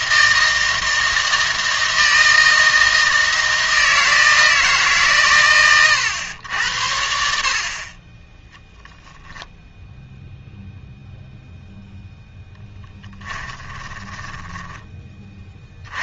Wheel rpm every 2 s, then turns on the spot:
160, 160, 160, 100, 0, 0, 10, 10.
12-14